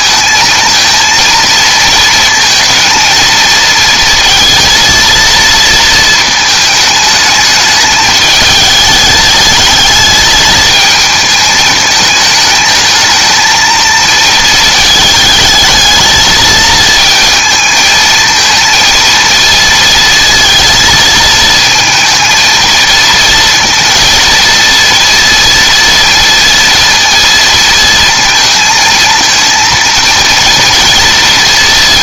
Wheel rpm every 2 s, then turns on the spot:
220, 230, 230, 220, 210, 220, 220, 220, 220, 230, 230, 230, 230, 230, 230, 230.
none